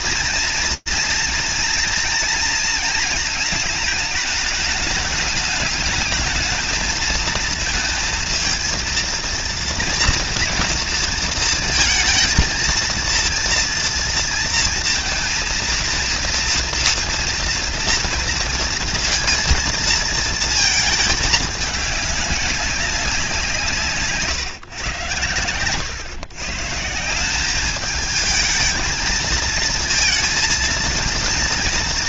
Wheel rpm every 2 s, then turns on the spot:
230, 220, 210, 220, 230, 230, 230, 230, 230, 230, 220, 190, 130, 180, 220, 230.
none